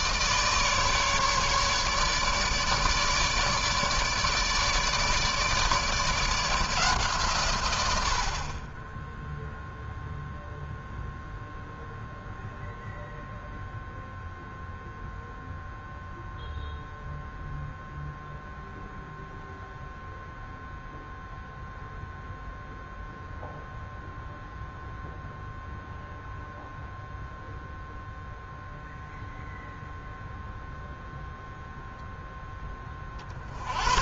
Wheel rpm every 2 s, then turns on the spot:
150, 150, 150, 160, 40, 0, 0, 0, 0, 0, 0, 0, 0, 0, 0, 0, 10.
none